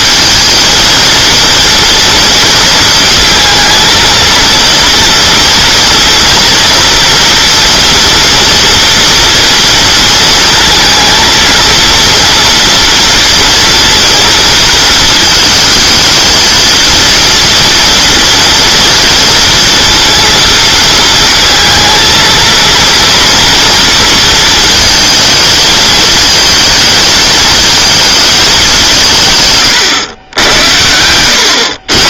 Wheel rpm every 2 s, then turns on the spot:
230, 230, 230, 230, 230, 230, 230, 230, 230, 230, 220, 230, 220, 220, 200, 80.
none